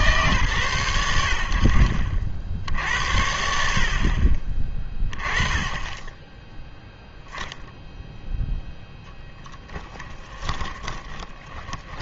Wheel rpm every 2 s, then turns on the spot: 110, 70, 20, 0, 0, 10.
10-12